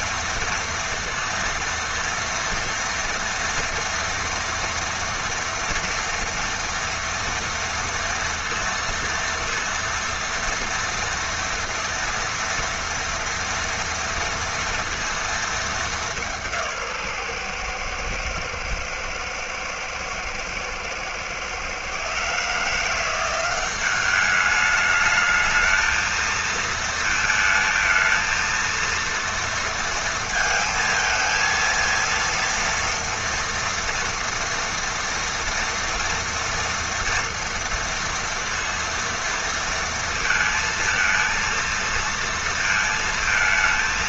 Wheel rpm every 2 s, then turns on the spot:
230, 230, 230, 230, 230, 240, 230, 230, 140, 110, 120, 170, 220, 230, 230, 230, 240, 230, 230, 230, 230, 230.
none